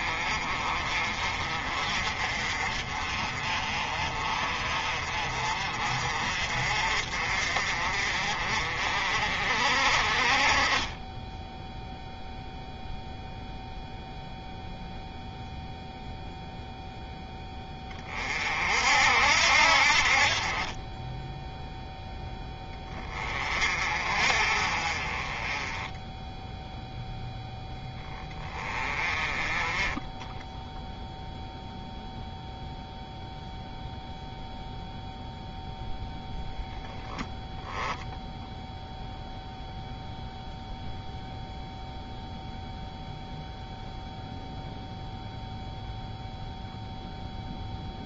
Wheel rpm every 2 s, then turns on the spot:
40, 40, 40, 50, 50, 20, 0, 0, 0, 60, 10, 20, 30, 0, 20, 0, 0, 0, 10, 0, 0, 0, 0, 0.
none